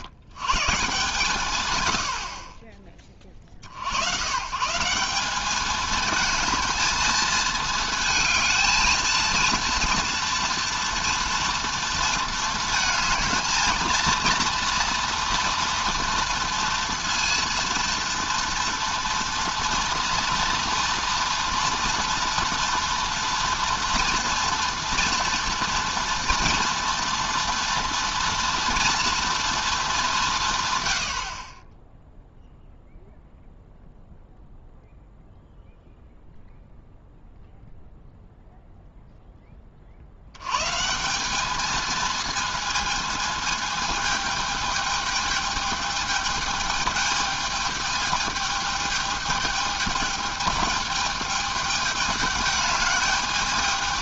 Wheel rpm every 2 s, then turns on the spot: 130, 30, 140, 220, 220, 230, 220, 230, 230, 230, 230, 240, 230, 230, 230, 130, 0, 0, 0, 0, 130, 220, 220, 210, 210, 210, 210.
none